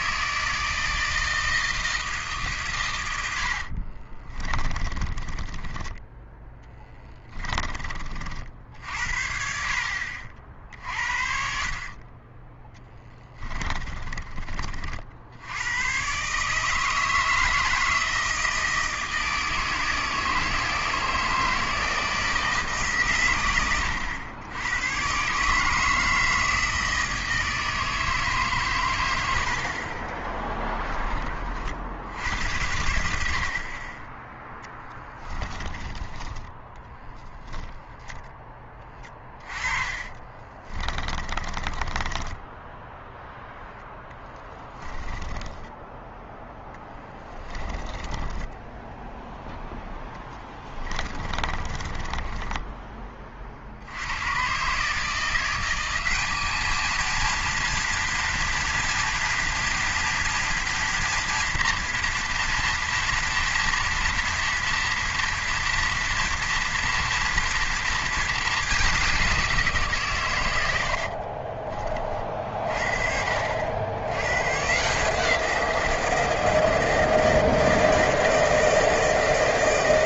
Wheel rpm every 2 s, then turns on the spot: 160, 140, 30, 10, 60, 60, 10, 40, 150, 160, 160, 160, 100, 160, 140, 10, 80, 10, 10, 10, 30, 10, 20, 20, 20, 20, 10, 130, 210, 230, 230, 230, 230, 240, 210, 100, 50, 130, 160, 160.
4-8 12-14 34-36 40-42 44-54